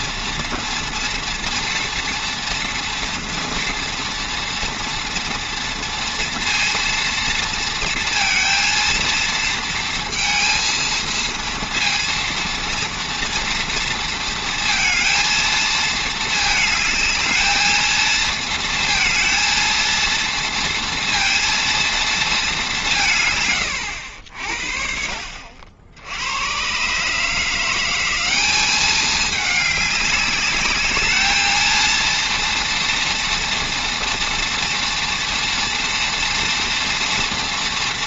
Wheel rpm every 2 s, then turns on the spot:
230, 230, 230, 230, 230, 230, 230, 230, 220, 230, 230, 170, 50, 130, 210, 210, 230, 240, 230.
none